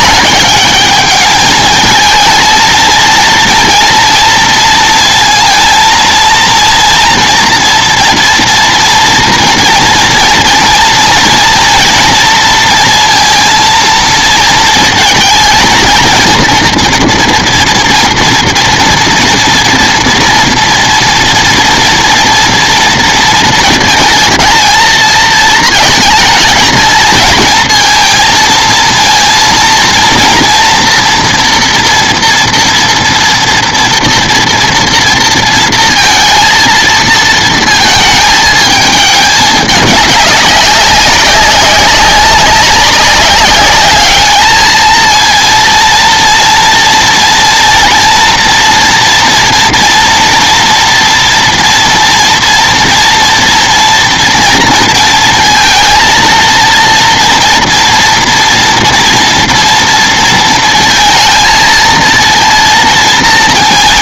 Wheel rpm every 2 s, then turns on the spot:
210, 220, 230, 230, 230, 230, 230, 230, 230, 230, 230, 240, 220, 220, 220, 230, 240, 230, 230, 220, 200, 200, 220, 230, 230, 240, 230, 230, 230, 230, 230, 230.
none